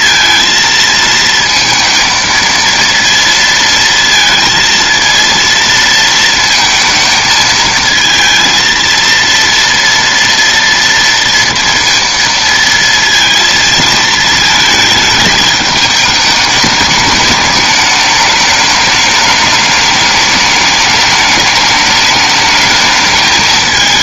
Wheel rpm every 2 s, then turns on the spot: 230, 230, 230, 230, 230, 230, 230, 220, 210, 210, 210, 220.
none